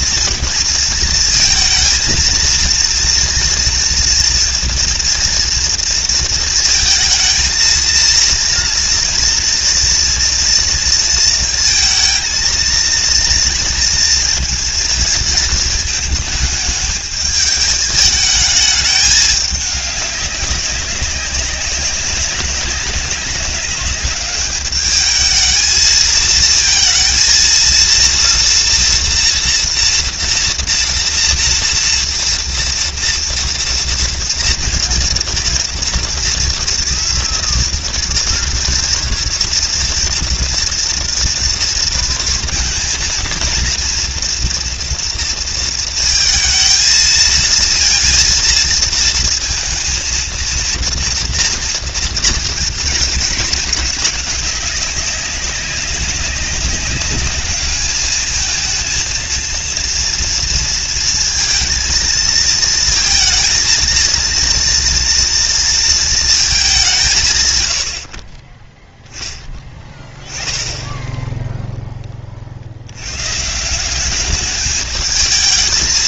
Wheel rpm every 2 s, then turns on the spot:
230, 230, 230, 220, 230, 230, 230, 230, 210, 210, 190, 200, 210, 220, 240, 230, 230, 230, 230, 230, 240, 230, 230, 220, 230, 230, 230, 190, 190, 220, 230, 230, 230, 190, 10, 20, 70, 210.
none